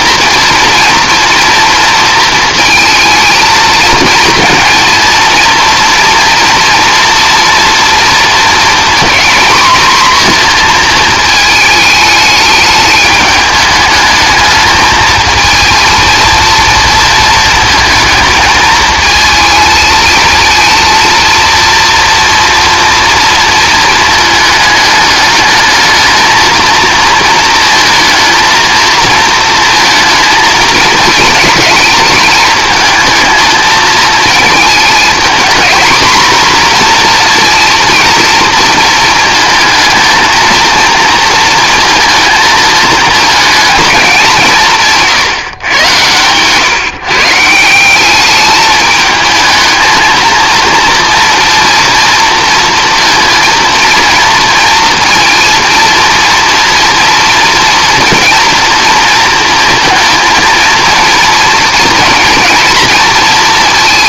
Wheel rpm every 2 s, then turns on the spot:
230, 220, 230, 230, 230, 230, 210, 210, 230, 220, 230, 230, 210, 230, 230, 220, 220, 220, 250, 220, 230, 220, 160, 140, 210, 230, 230, 230, 230, 230, 220, 230.
none